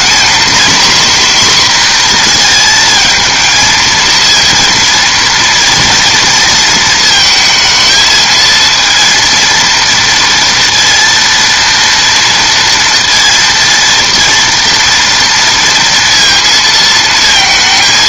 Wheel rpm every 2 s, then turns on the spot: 250, 230, 230, 230, 230, 230, 230, 230, 220.
none